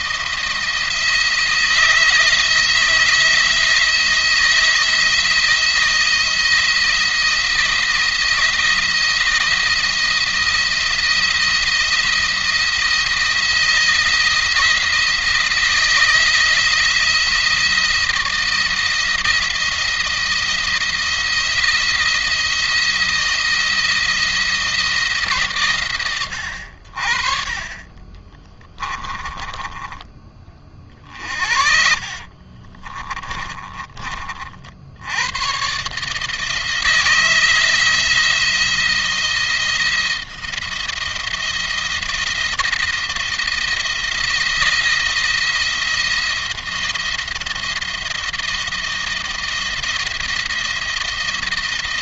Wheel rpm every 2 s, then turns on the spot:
170, 170, 170, 170, 170, 170, 170, 170, 170, 170, 170, 170, 160, 60, 30, 40, 30, 70, 160, 170, 170, 170, 170, 170, 170, 170.
28-34